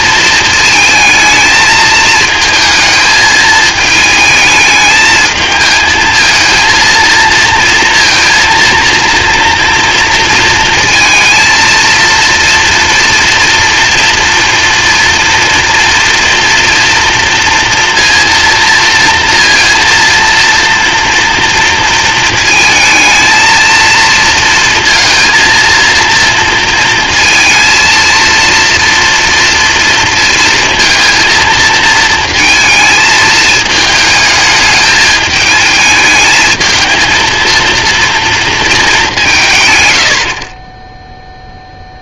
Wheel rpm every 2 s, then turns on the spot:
220, 220, 220, 230, 230, 230, 230, 230, 230, 230, 230, 220, 230, 230, 240, 230, 220, 210, 220, 190, 10.
none